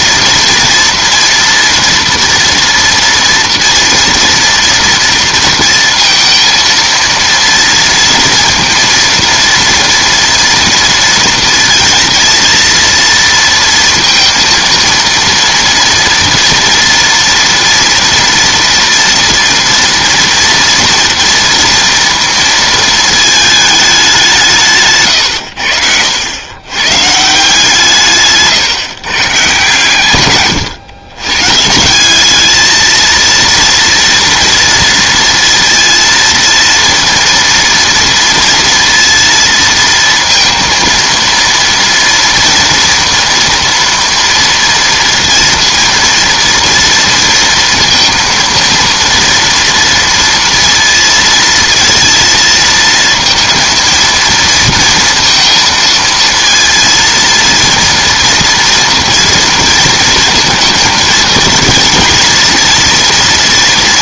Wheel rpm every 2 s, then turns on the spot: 230, 230, 230, 230, 230, 230, 230, 230, 230, 230, 230, 230, 180, 110, 140, 130, 220, 230, 230, 230, 230, 230, 230, 230, 230, 230, 230, 230, 230, 230, 220, 230.
none